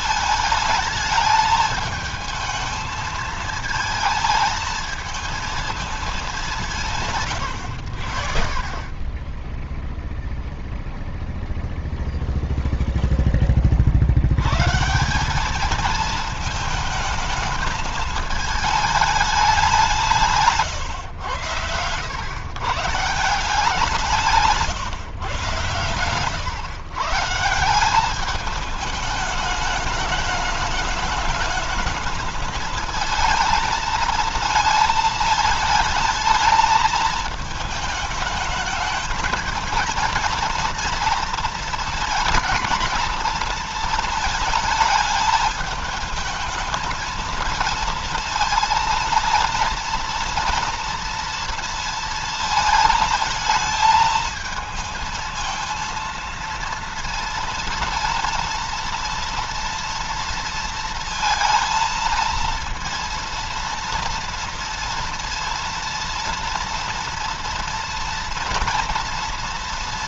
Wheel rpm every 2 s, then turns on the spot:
220, 220, 220, 190, 50, 0, 0, 100, 220, 220, 140, 120, 150, 120, 210, 210, 220, 230, 220, 210, 230, 220, 220, 220, 230, 230, 220, 220, 230, 230, 230, 230, 230, 230, 230.
none